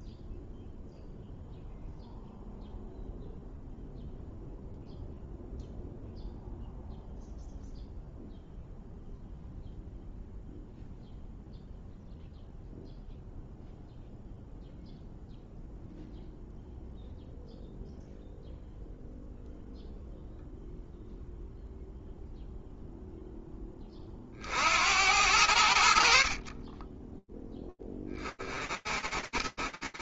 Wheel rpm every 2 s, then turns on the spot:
0, 0, 0, 0, 0, 0, 0, 0, 0, 0, 0, 0, 60, 10, 30.
none